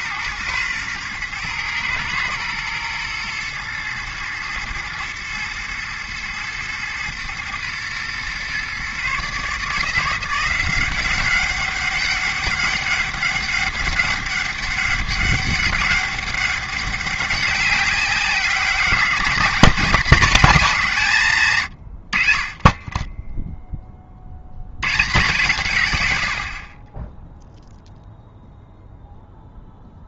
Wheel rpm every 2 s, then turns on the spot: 120, 120, 110, 120, 140, 190, 200, 200, 200, 210, 190, 10, 120, 10, 0.
none